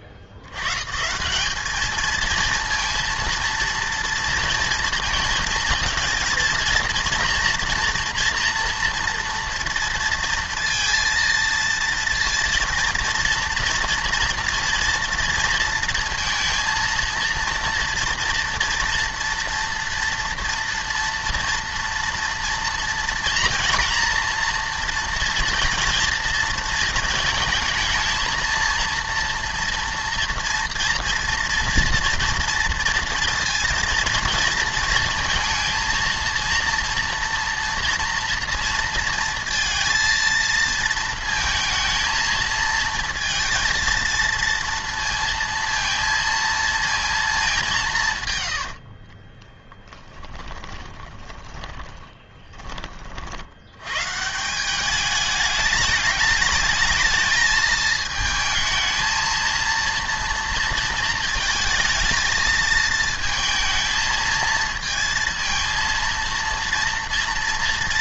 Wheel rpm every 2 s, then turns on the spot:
80, 230, 230, 230, 230, 230, 230, 230, 230, 230, 230, 230, 230, 230, 230, 230, 230, 230, 230, 230, 230, 230, 230, 230, 70, 20, 10, 190, 210, 220, 230, 220, 230, 230.
48-52